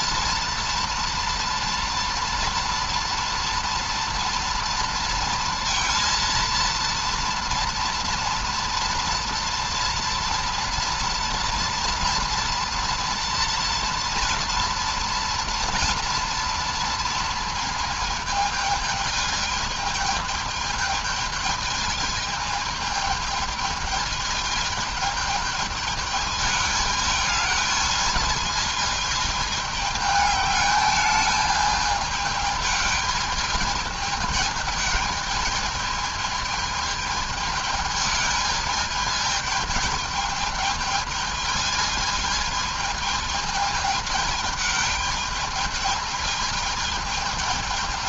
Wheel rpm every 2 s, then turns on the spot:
230, 230, 230, 230, 230, 230, 230, 230, 230, 220, 220, 220, 220, 210, 220, 210, 210, 220, 220, 220, 220, 220, 210, 220.
none